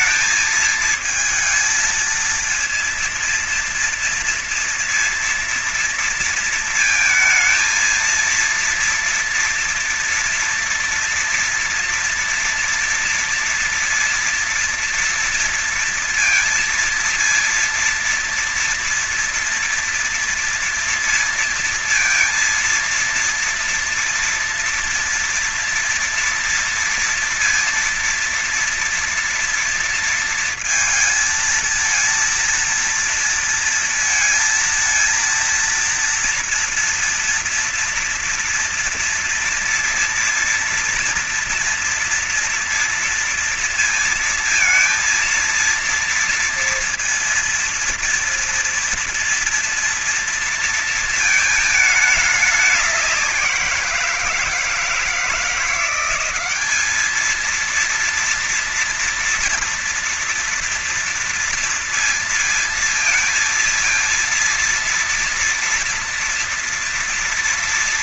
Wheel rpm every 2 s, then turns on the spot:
220, 230, 230, 230, 230, 230, 230, 230, 230, 240, 230, 230, 230, 230, 230, 230, 230, 220, 230, 230, 230, 230, 230, 230, 240, 230, 200, 160, 190, 230, 230, 230, 230, 230.
none